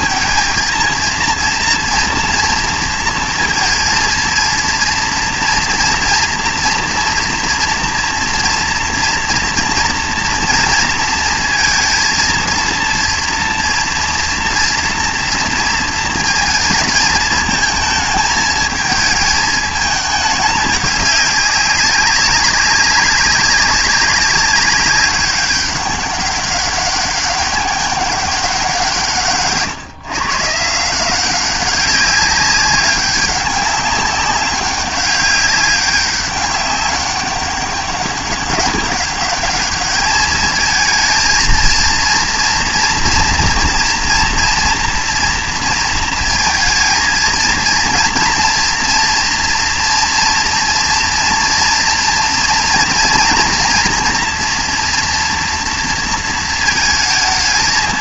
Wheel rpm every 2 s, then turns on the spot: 230, 230, 230, 240, 230, 230, 230, 230, 220, 220, 210, 200, 200, 200, 190, 150, 190, 200, 200, 200, 220, 230, 230, 230, 230, 230, 230, 230, 230.
none